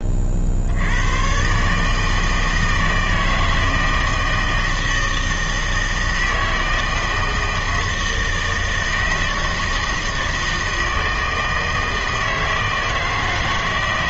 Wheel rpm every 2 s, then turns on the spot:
60, 160, 160, 160, 160, 160, 160.
none